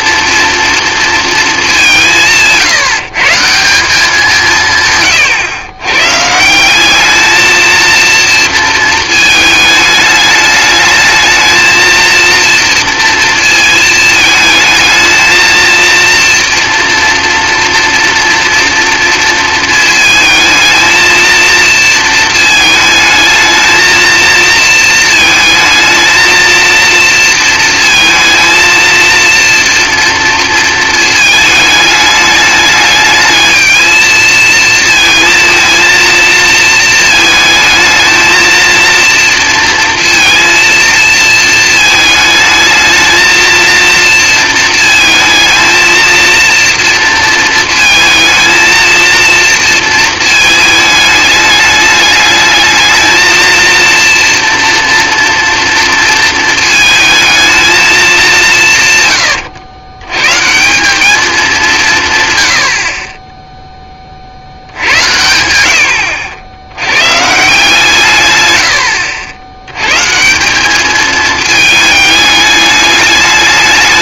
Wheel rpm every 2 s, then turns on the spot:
230, 180, 170, 160, 230, 210, 230, 220, 230, 230, 220, 220, 230, 230, 230, 230, 210, 220, 230, 230, 230, 220, 230, 230, 220, 220, 210, 230, 220, 170, 170, 130, 70, 90, 110, 170, 210.
none